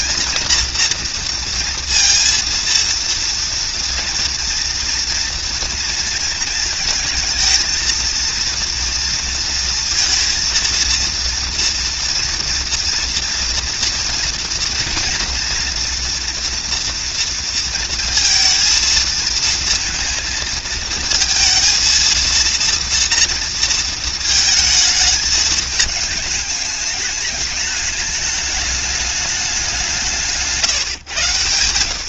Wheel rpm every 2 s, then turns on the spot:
230, 230, 230, 230, 230, 230, 230, 230, 230, 230, 220, 230, 220, 210, 210, 140.
none